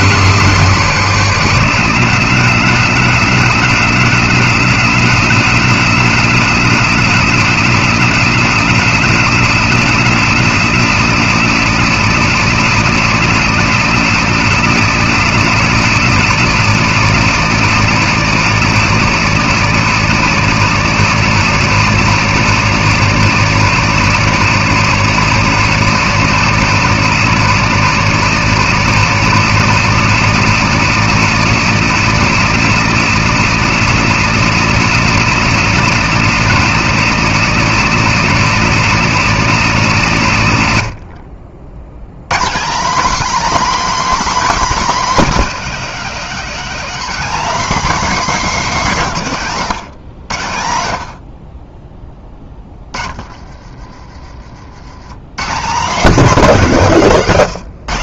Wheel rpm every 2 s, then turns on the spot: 230, 250, 250, 250, 240, 240, 240, 240, 240, 240, 240, 240, 240, 240, 240, 240, 240, 240, 240, 240, 90, 260, 270, 260, 200, 60, 30, 130, 210.
52-54